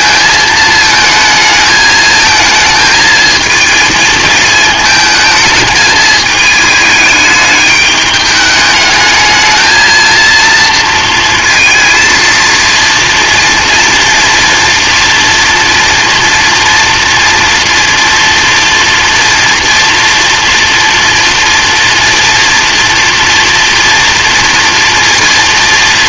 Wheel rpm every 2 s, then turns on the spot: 220, 220, 220, 210, 210, 230, 230, 230, 230, 230, 230, 230, 230.
none